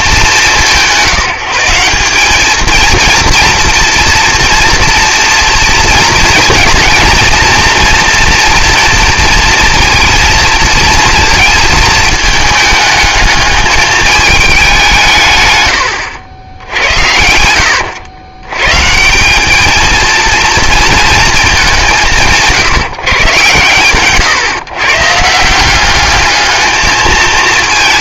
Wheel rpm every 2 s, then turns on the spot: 180, 220, 240, 230, 230, 230, 220, 200, 80, 120, 230, 160, 130, 220.
16-18